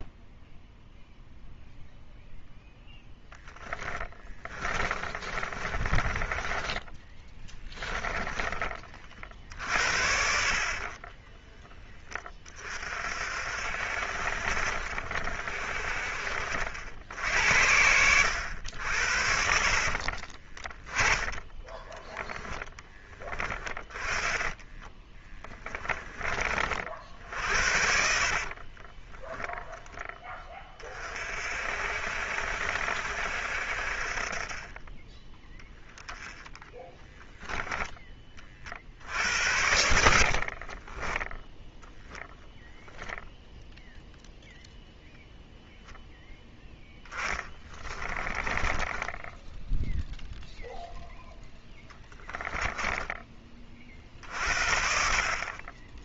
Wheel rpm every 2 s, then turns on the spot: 0, 10, 20, 20, 20, 40, 30, 60, 70, 80, 20, 10, 10, 50, 30, 20, 60, 30, 10, 50, 40, 0, 0, 10, 10, 0, 10, 50.
2-8 10-12 20-22 24-26 28-30 36-38 40-42 48-50 52-54